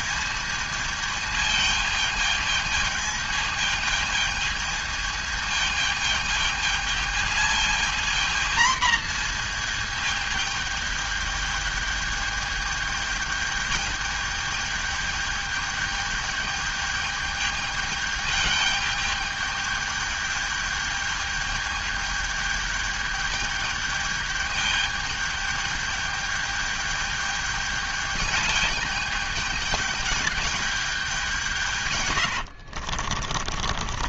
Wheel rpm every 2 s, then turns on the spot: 220, 220, 220, 220, 230, 220, 210, 210, 210, 210, 210, 210, 210, 210, 210, 210, 90.
32-34